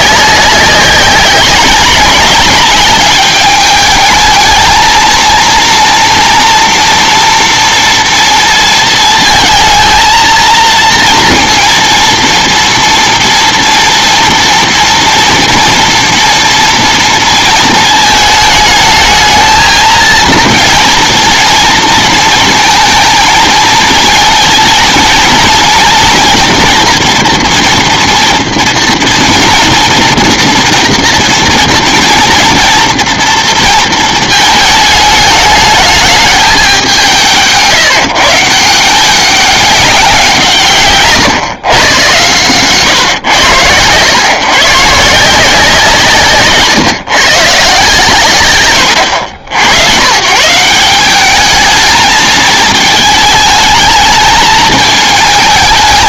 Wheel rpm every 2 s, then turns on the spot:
190, 200, 220, 230, 230, 230, 230, 230, 230, 210, 230, 220, 230, 240, 230, 230, 230, 210, 190, 160, 150, 130, 140, 140, 100, 170, 220, 220.
48-50